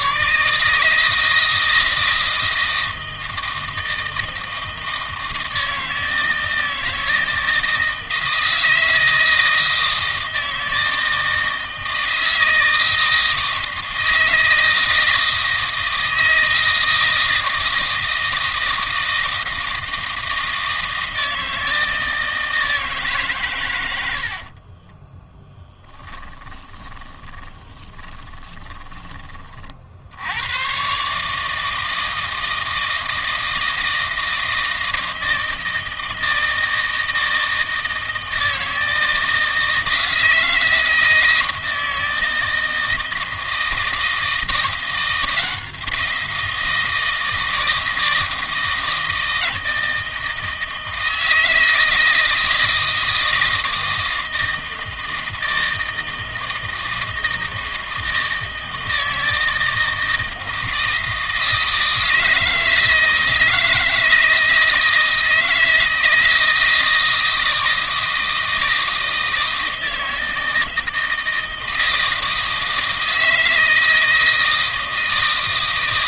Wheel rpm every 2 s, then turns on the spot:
160, 160, 160, 160, 160, 160, 160, 160, 160, 160, 160, 150, 30, 30, 20, 130, 160, 160, 160, 160, 160, 160, 170, 170, 160, 160, 160, 160, 160, 160, 160, 160, 160, 160, 160, 160, 160, 160.
24-28